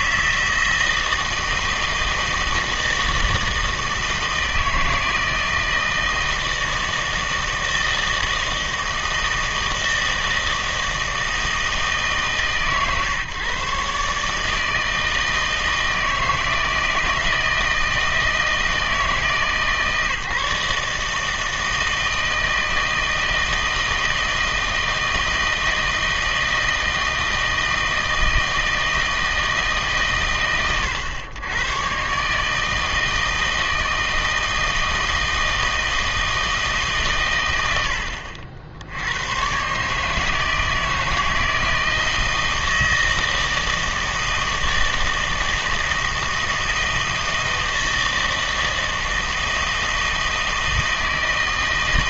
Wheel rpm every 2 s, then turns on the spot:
160, 160, 160, 160, 160, 160, 140, 160, 160, 160, 150, 160, 160, 160, 160, 110, 160, 160, 150, 70, 160, 160, 160, 160, 160, 160.
none